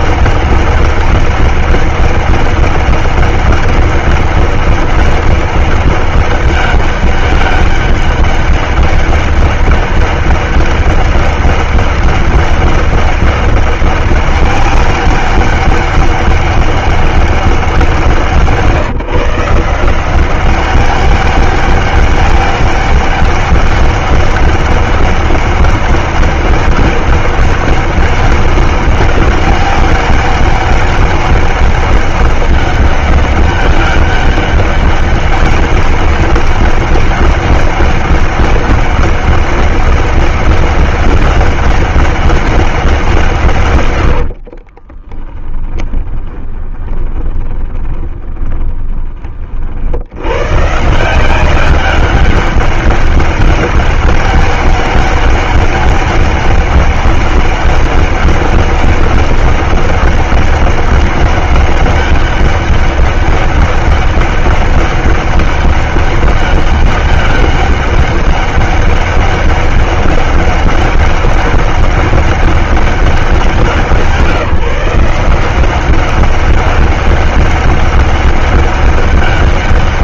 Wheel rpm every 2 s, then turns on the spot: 200, 200, 200, 200, 200, 200, 200, 200, 200, 170, 180, 200, 200, 200, 200, 200, 200, 200, 200, 200, 200, 200, 70, 10, 20, 100, 200, 200, 200, 200, 200, 200, 200, 200, 200, 200, 200, 170, 190, 200.
44-50